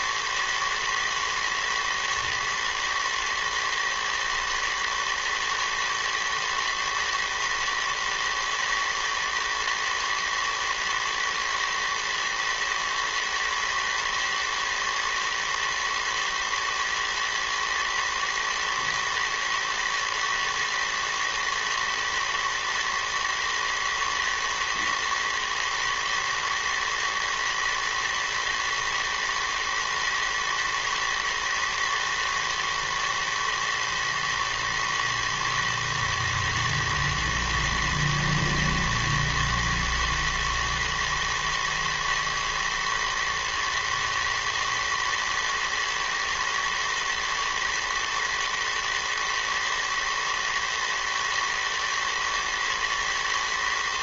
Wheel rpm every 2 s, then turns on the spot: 110, 110, 110, 110, 110, 110, 110, 120, 110, 110, 110, 120, 120, 110, 120, 110, 110, 110, 120, 110, 110, 110, 110, 110, 110, 110, 110.
none